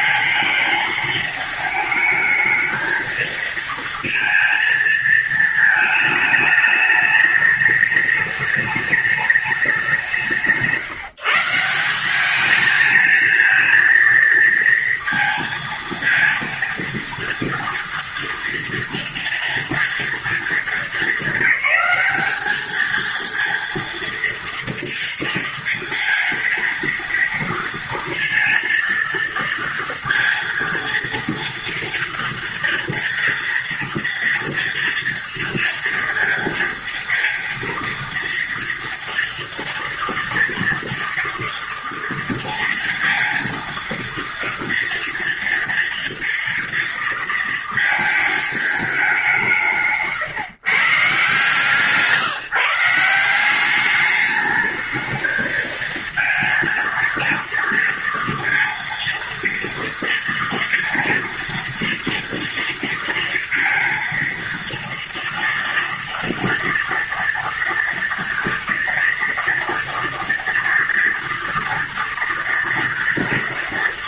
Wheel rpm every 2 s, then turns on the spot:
230, 220, 220, 210, 210, 180, 210, 230, 230, 240, 220, 210, 230, 230, 230, 230, 230, 230, 230, 230, 240, 230, 230, 230, 220, 140, 160, 210, 230, 230, 230, 230, 230, 230, 230, 230, 230.
none